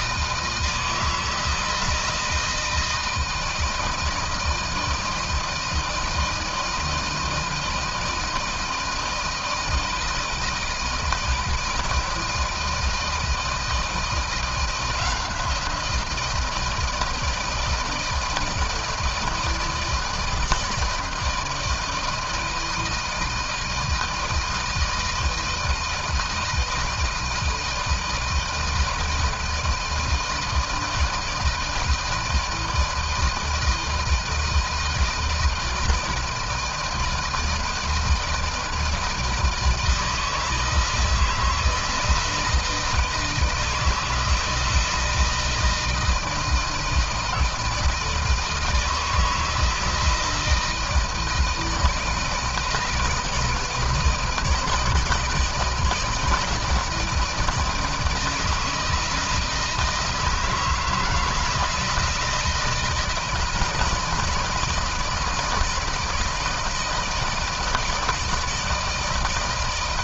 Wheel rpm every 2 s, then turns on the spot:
160, 160, 160, 160, 160, 160, 160, 170, 170, 160, 160, 160, 160, 160, 170, 160, 160, 160, 160, 160, 160, 160, 160, 160, 160, 160, 160, 160, 160, 160, 160, 160, 160, 160, 160.
none